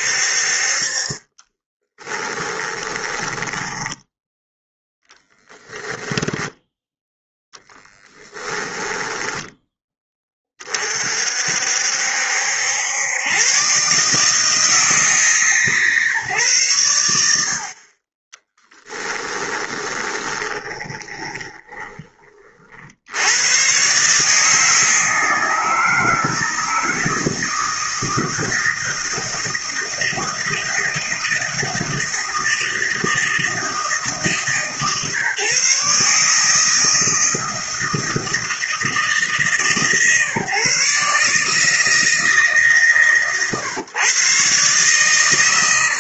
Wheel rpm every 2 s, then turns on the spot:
40, 10, 0, 10, 10, 40, 90, 160, 110, 10, 20, 60, 160, 160, 160, 160, 160, 140, 160, 160, 140, 140, 130.
2-4 18-22